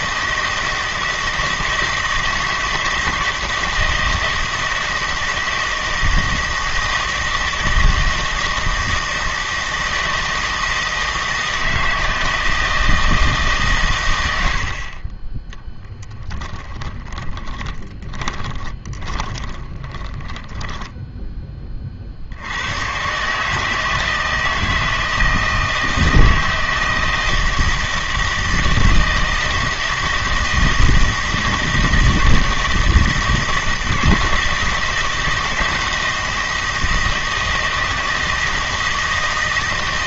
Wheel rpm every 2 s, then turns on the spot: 160, 160, 160, 160, 170, 160, 160, 40, 10, 20, 10, 110, 160, 160, 160, 160, 160, 160, 160, 160.
16-22